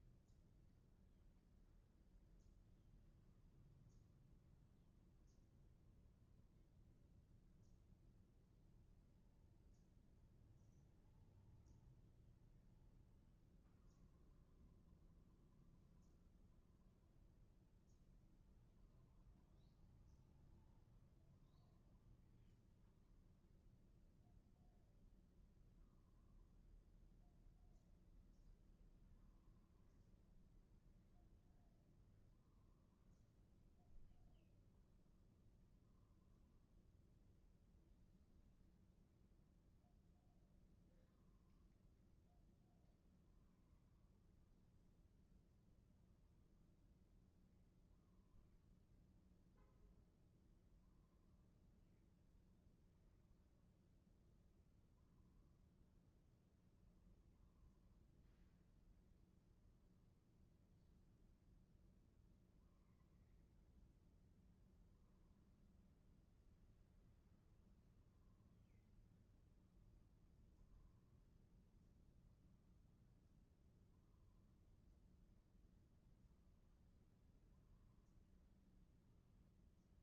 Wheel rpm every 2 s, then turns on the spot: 0, 0, 0, 0, 0, 0, 0, 0, 0, 0, 0, 0, 0, 0, 0, 0, 0, 0, 0, 0, 0, 0, 0, 0, 0, 0, 0, 0, 0, 0, 0, 0, 0, 0, 0, 0, 0, 0, 0, 0.
none